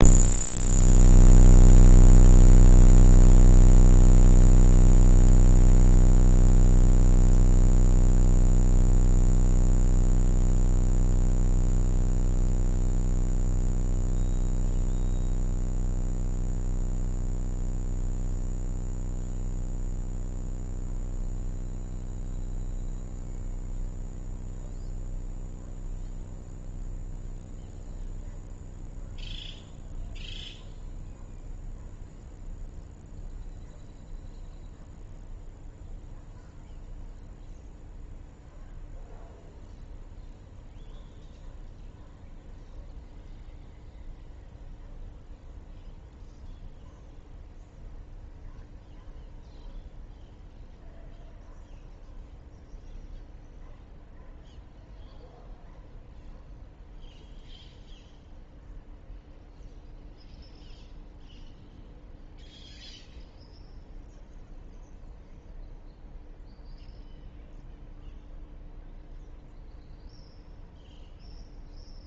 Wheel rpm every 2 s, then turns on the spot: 0, 0, 0, 0, 0, 0, 0, 0, 0, 0, 0, 0, 0, 0, 0, 0, 0, 0, 0, 0, 0, 0, 0, 0, 0, 0, 0, 0, 0, 0, 0, 0, 0, 0, 0, 0.
none